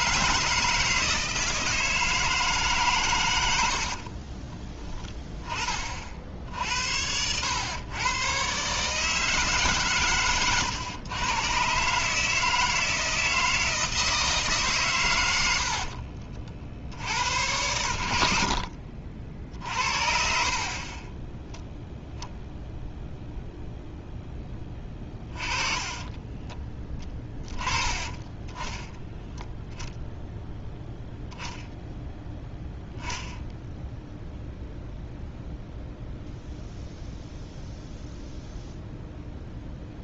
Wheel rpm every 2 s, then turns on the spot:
30, 120, 130, 40, 130, 120, 160, 150, 60, 40, 30, 0, 20, 10, 10, 0, 0, 0, 0, 0.
18-22 24-26